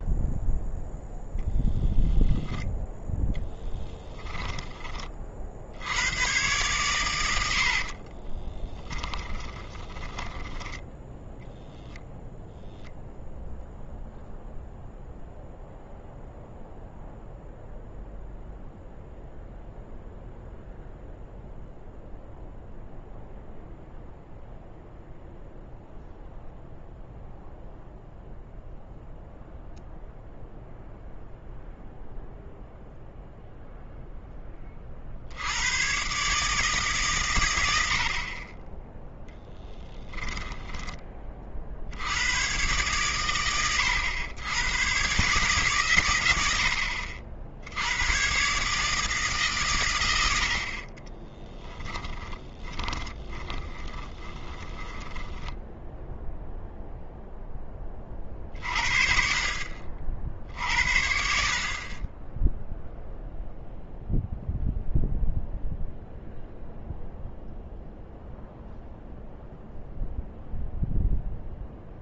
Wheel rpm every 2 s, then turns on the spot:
10, 10, 20, 110, 10, 10, 0, 0, 0, 0, 0, 0, 0, 0, 0, 0, 0, 40, 150, 10, 10, 120, 110, 70, 150, 40, 20, 20, 0, 50, 70, 0, 0, 0, 0, 0.
0-2 8-10 40-42 52-56